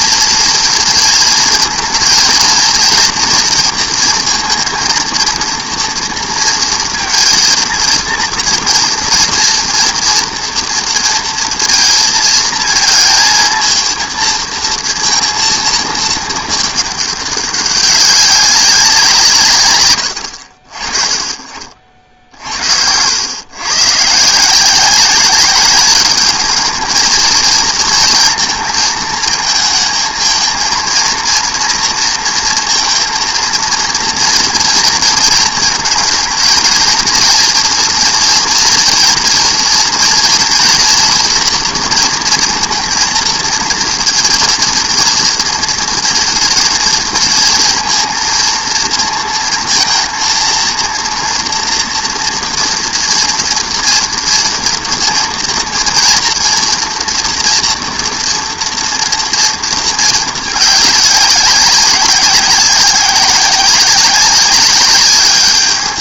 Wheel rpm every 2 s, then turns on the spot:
230, 230, 230, 230, 230, 230, 230, 230, 210, 190, 50, 70, 180, 220, 220, 230, 230, 230, 230, 230, 240, 230, 230, 230, 230, 230, 230, 230, 240, 230, 210, 190, 190.
none